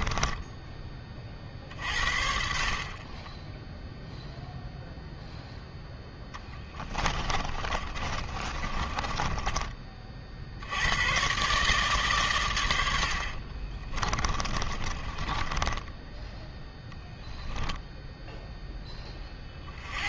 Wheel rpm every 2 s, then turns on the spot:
20, 40, 0, 20, 30, 90, 110, 20, 0, 10.
6-10 14-16